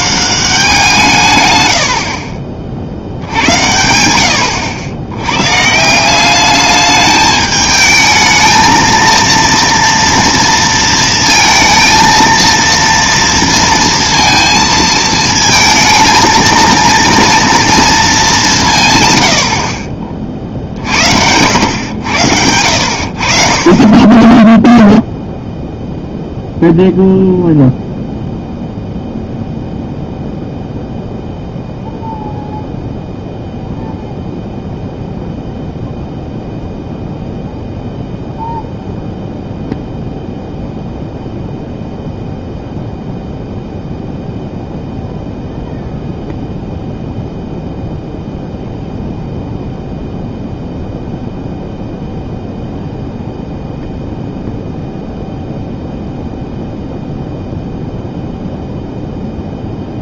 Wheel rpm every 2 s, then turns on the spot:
180, 50, 80, 200, 220, 230, 230, 230, 230, 160, 50, 80, 10, 0, 0, 0, 0, 0, 0, 0, 0, 0, 0, 0, 0, 0, 0, 0, 0, 0.
none